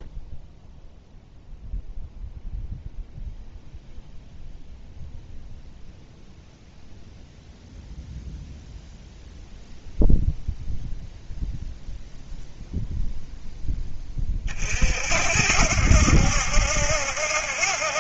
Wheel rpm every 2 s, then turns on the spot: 0, 0, 0, 0, 0, 0, 0, 40, 70.
none